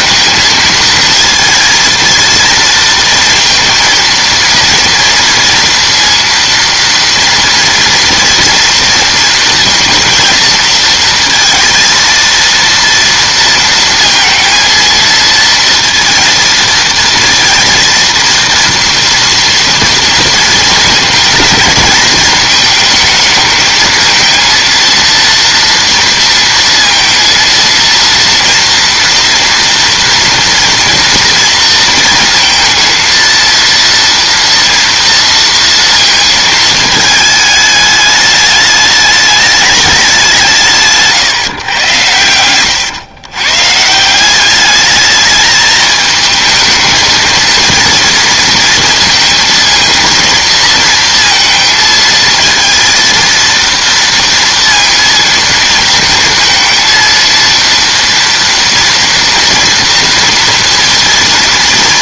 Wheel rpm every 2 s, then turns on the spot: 230, 230, 230, 230, 230, 220, 230, 230, 230, 230, 220, 220, 230, 230, 230, 230, 230, 230, 220, 210, 160, 110, 210, 220, 230, 230, 230, 230, 230, 230, 230.
none